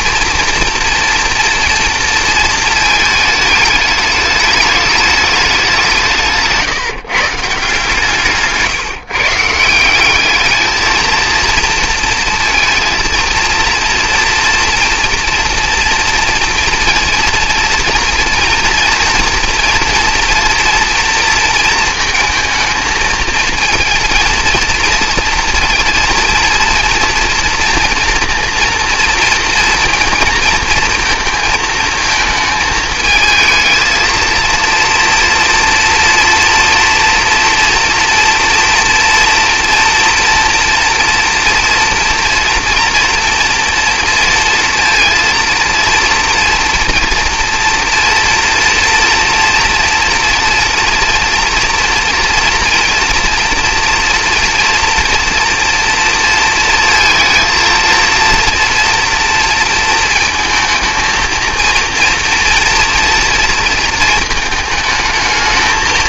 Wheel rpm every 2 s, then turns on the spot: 230, 230, 210, 160, 150, 220, 230, 230, 230, 230, 230, 220, 230, 230, 230, 230, 220, 230, 230, 230, 230, 230, 230, 230, 230, 230, 230, 230, 230, 230, 220, 230, 220.
8-10